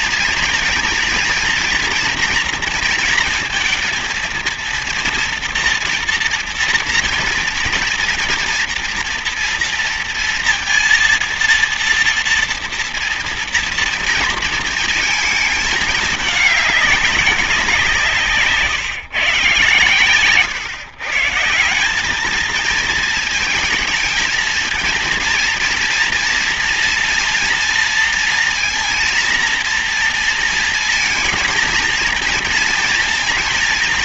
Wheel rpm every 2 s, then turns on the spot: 230, 240, 230, 230, 230, 230, 230, 230, 210, 150, 130, 220, 230, 230, 230, 230, 230.
none